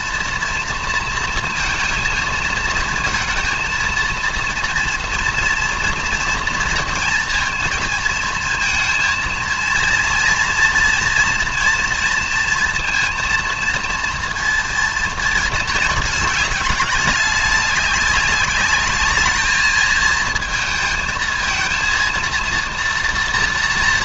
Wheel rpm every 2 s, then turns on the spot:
230, 230, 230, 230, 230, 230, 230, 230, 210, 210, 230, 230.
none